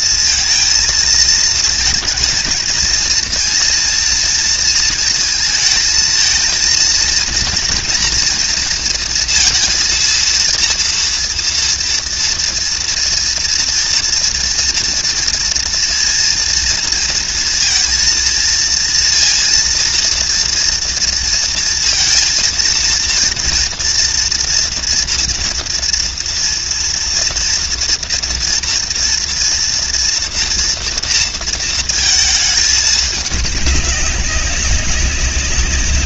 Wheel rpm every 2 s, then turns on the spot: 230, 230, 230, 230, 230, 230, 230, 230, 230, 230, 230, 230, 230, 230, 230, 230, 220, 200.
none